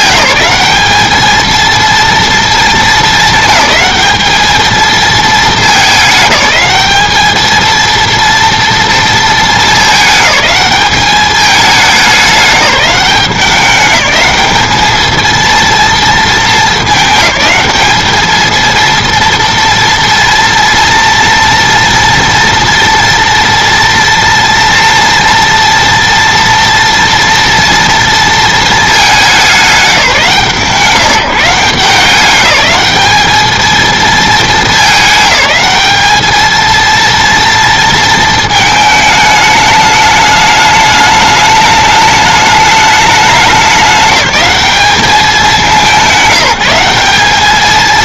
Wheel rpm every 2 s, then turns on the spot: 210, 220, 220, 210, 230, 210, 200, 220, 210, 230, 230, 230, 230, 230, 210, 160, 210, 210, 230, 220, 210, 210, 210, 190.
none